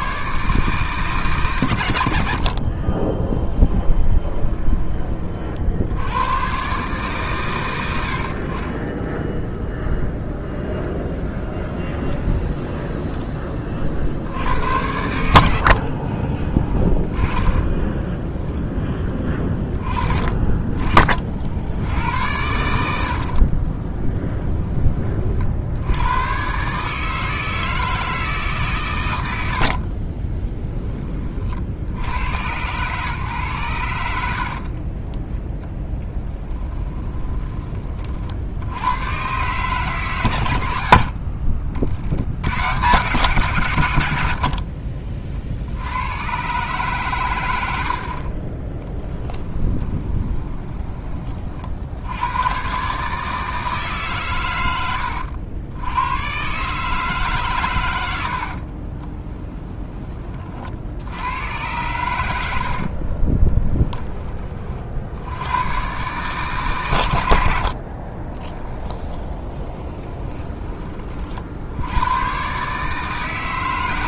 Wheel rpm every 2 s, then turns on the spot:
140, 50, 20, 120, 50, 10, 10, 80, 20, 10, 30, 80, 10, 130, 140, 20, 100, 60, 10, 80, 100, 110, 70, 130, 30, 20, 110, 110, 140, 60, 40, 70, 30, 140, 20, 20, 130.
2-6 10-14 16-18 30-32 34-38 50-52 58-60 62-64 68-70